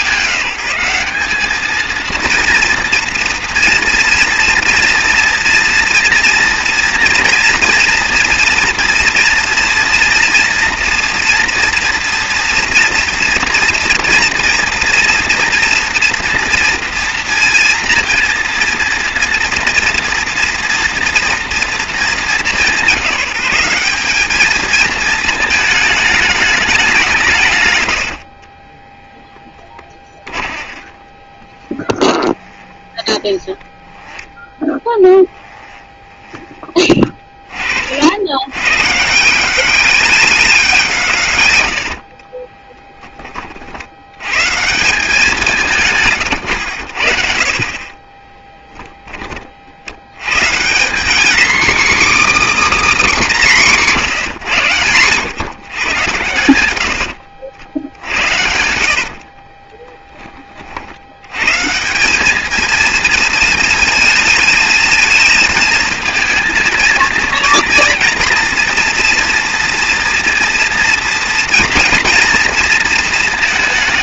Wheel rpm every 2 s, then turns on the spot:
190, 240, 230, 230, 230, 230, 230, 240, 230, 230, 240, 190, 220, 200, 30, 20, 20, 10, 20, 110, 180, 20, 170, 100, 10, 160, 300, 130, 100, 80, 50, 220, 220, 230, 230, 230, 230.
28-38 42-44 48-50